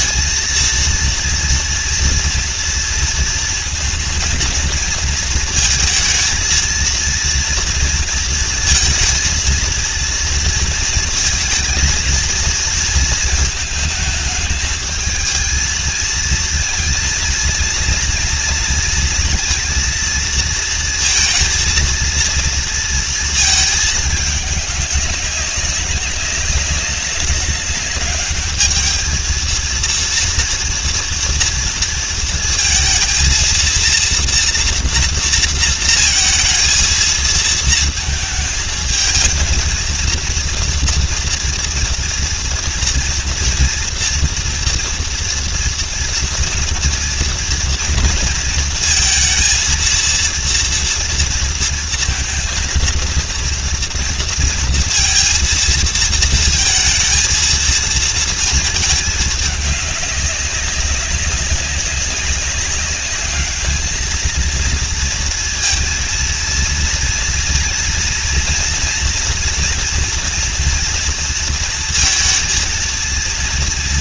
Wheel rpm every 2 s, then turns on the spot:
230, 230, 230, 230, 230, 230, 230, 220, 230, 230, 230, 230, 200, 200, 220, 230, 230, 230, 230, 220, 230, 230, 230, 230, 230, 230, 230, 230, 220, 220, 200, 190, 230, 230, 230, 230, 230.
none